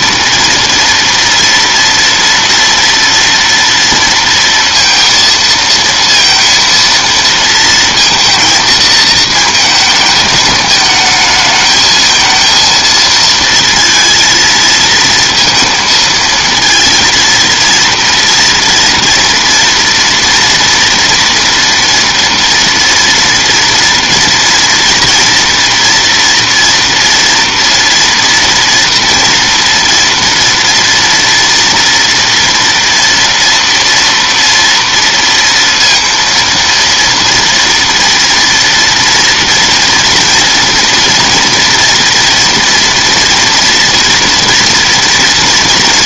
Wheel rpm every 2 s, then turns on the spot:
230, 230, 230, 230, 230, 220, 220, 230, 230, 230, 240, 230, 230, 230, 230, 230, 230, 230, 230, 230, 230, 230, 240.
none